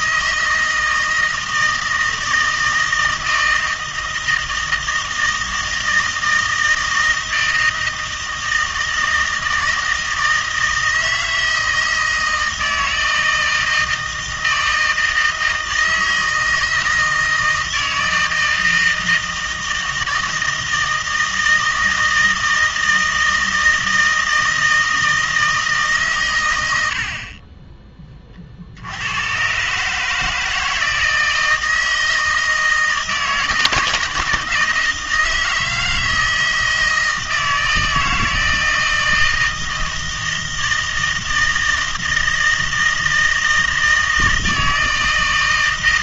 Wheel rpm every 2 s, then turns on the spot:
160, 160, 160, 160, 160, 160, 160, 160, 160, 160, 160, 160, 160, 90, 70, 160, 160, 160, 160, 160, 160, 160, 160.
none